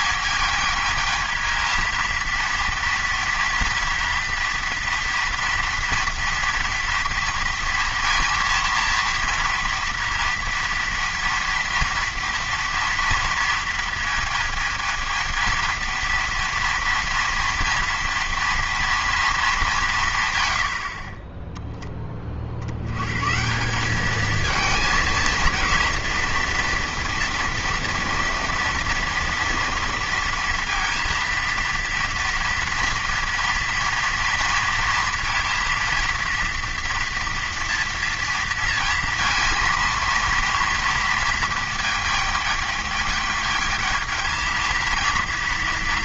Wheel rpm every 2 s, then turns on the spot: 220, 230, 230, 230, 230, 240, 230, 220, 230, 230, 90, 60, 220, 230, 230, 230, 230, 230, 240, 230, 230, 210, 220.
none